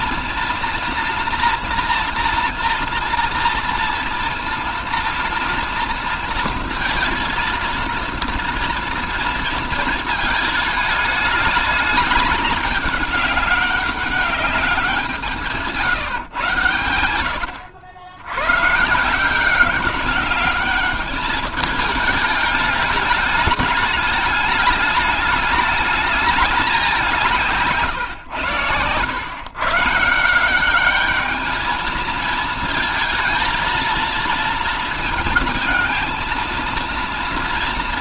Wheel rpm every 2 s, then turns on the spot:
230, 230, 230, 230, 230, 210, 200, 190, 120, 140, 210, 210, 210, 190, 110, 200, 220, 220, 230.
none